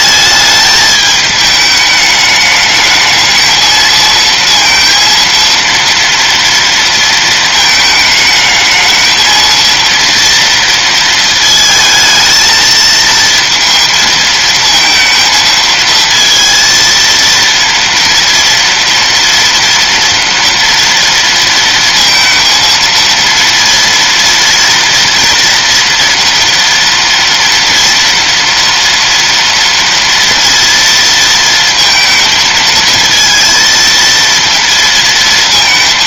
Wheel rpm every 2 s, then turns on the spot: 210, 210, 230, 230, 220, 230, 220, 230, 230, 230, 230, 230, 230, 230, 230, 230, 220, 230.
none